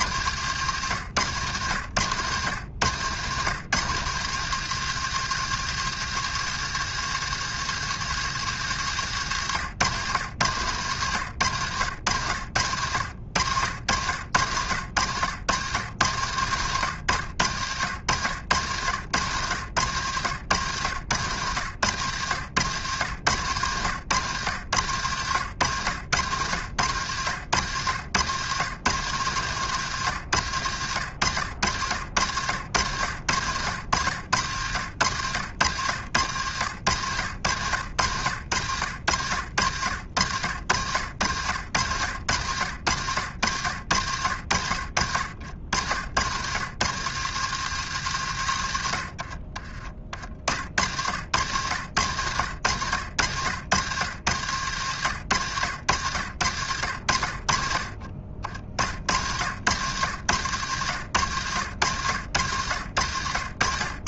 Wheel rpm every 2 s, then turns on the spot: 120, 110, 140, 150, 140, 110, 80, 100, 100, 90, 100, 110, 110, 100, 100, 110, 90, 90, 90, 90, 80, 90, 80, 100, 110, 40, 100, 100, 90, 50, 100, 90.
none